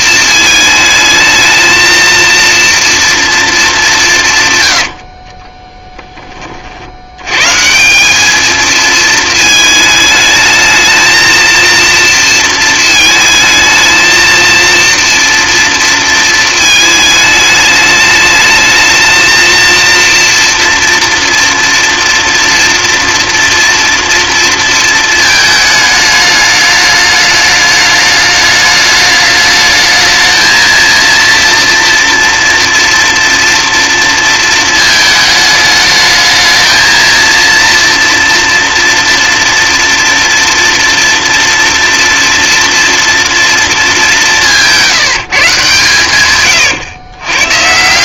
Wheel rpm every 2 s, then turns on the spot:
220, 230, 130, 60, 220, 220, 220, 230, 220, 220, 230, 230, 230, 210, 210, 230, 230, 220, 230, 240, 230, 230, 170, 130.
46-48